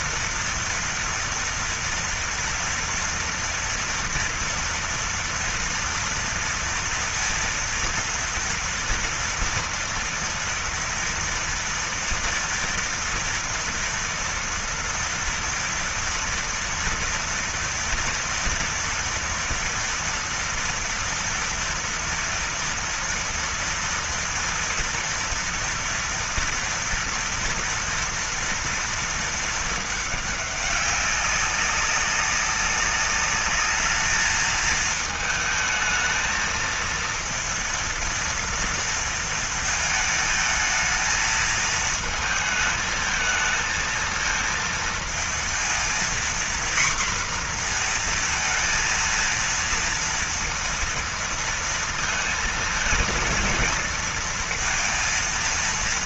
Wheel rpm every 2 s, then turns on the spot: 230, 230, 230, 230, 230, 230, 230, 230, 230, 230, 230, 240, 230, 240, 230, 200, 200, 220, 220, 230, 220, 220, 230, 240, 230, 230, 220, 230.
none